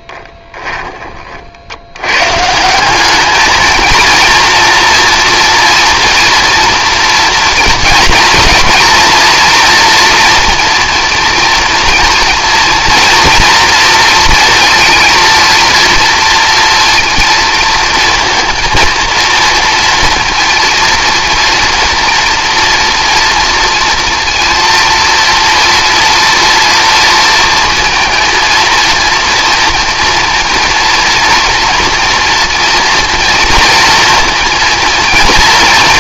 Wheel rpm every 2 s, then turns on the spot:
20, 180, 230, 230, 230, 230, 230, 230, 230, 230, 230, 230, 230, 230, 230, 230, 230, 230.
none